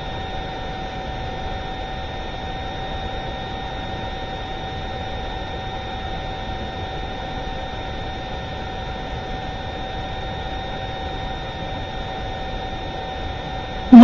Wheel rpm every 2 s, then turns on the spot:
0, 0, 0, 0, 0, 0, 0.
none